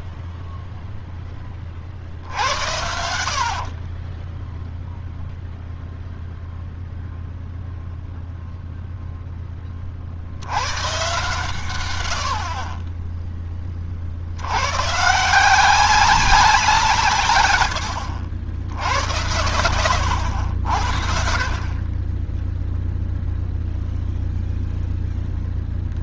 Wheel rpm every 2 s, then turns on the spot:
30, 40, 0, 0, 0, 110, 30, 100, 180, 80, 70, 0, 0.
2-4